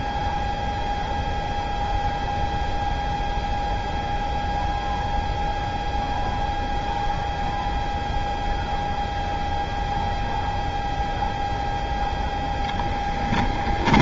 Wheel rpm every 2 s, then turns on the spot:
0, 0, 0, 0, 0, 0, 0.
none